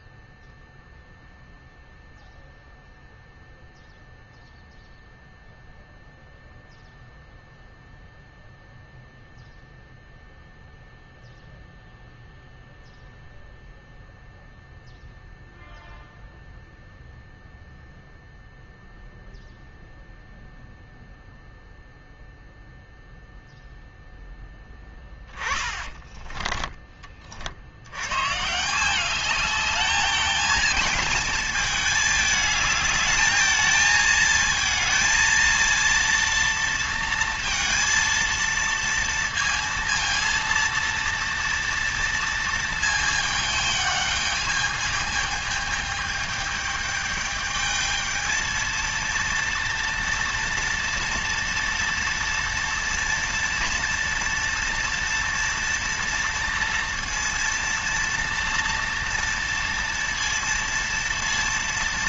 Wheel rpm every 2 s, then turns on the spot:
0, 0, 0, 0, 0, 0, 0, 0, 0, 0, 0, 0, 10, 20, 170, 220, 210, 220, 230, 230, 230, 220, 210, 210, 230, 230, 230, 230, 230, 230, 230.
none